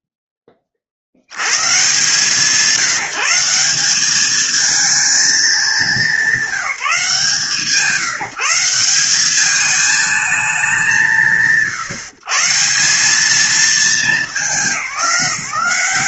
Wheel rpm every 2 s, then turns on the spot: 80, 180, 200, 170, 210, 120, 210, 190.
none